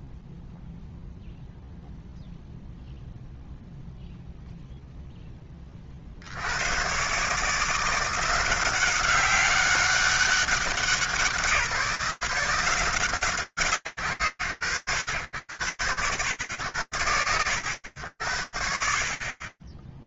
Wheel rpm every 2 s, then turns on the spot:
0, 0, 0, 120, 190, 180, 160, 80, 110, 50.
none